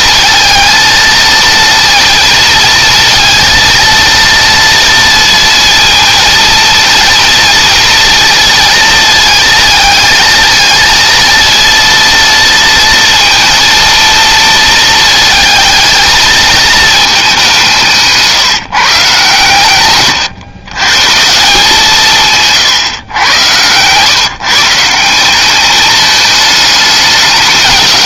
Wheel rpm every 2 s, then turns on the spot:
230, 230, 230, 230, 230, 230, 230, 220, 210, 140, 150, 130, 190, 210.
none